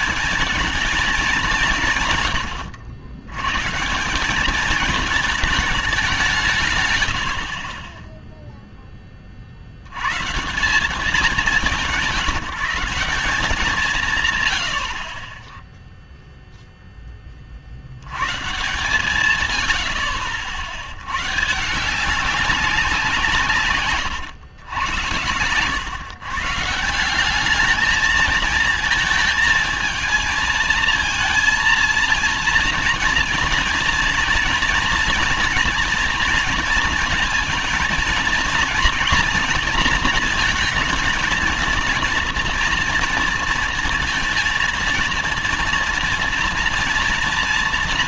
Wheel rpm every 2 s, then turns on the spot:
200, 110, 190, 180, 10, 150, 170, 140, 0, 130, 80, 190, 100, 130, 220, 220, 230, 230, 230, 230, 220, 230, 230, 230.
none